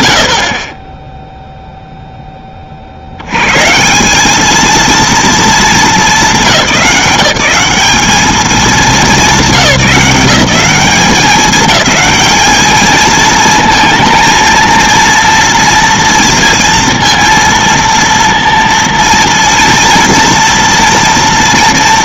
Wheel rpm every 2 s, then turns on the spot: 40, 40, 220, 190, 220, 200, 220, 230, 230, 230, 230.
none